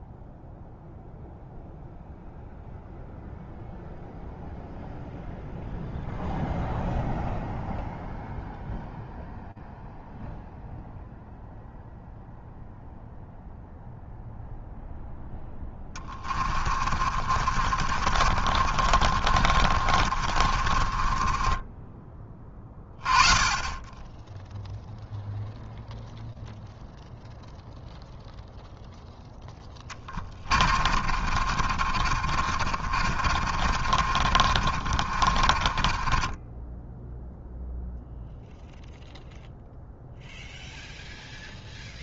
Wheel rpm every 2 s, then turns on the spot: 0, 0, 0, 0, 0, 0, 0, 0, 40, 50, 40, 20, 0, 0, 0, 30, 40, 50, 10, 0, 0.
16-22 30-38